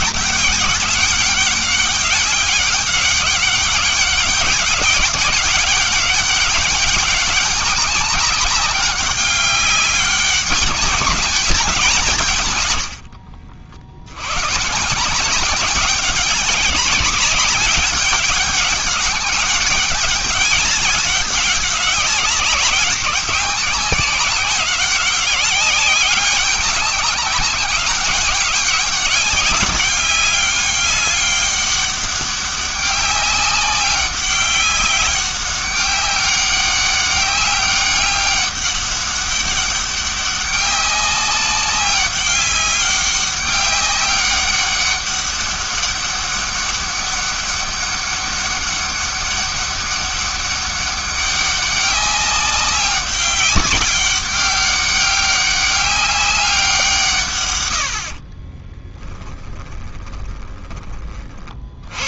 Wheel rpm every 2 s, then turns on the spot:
200, 200, 190, 200, 190, 200, 110, 140, 200, 200, 200, 190, 190, 200, 190, 200, 200, 200, 200, 200, 200, 190, 200, 200, 200, 200, 200, 200, 180, 20, 20.
58-60